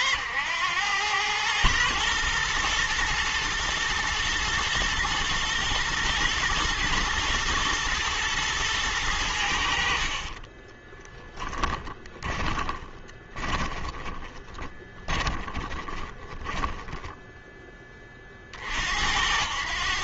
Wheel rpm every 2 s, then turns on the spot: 100, 110, 120, 120, 110, 20, 20, 20, 10, 60.
10-18